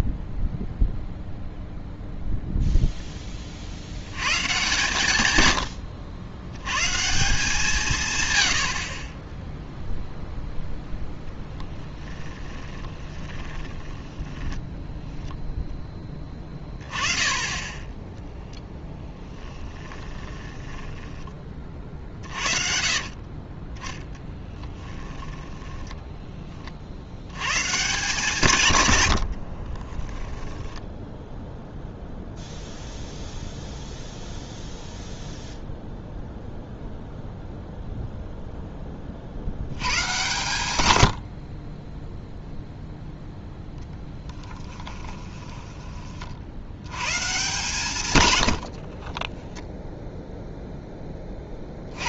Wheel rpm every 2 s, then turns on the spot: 0, 0, 130, 120, 70, 0, 10, 10, 30, 10, 20, 50, 10, 30, 130, 10, 0, 0, 0, 10, 130, 0, 10, 80, 90, 0.
12-16 20-26 30-32 44-46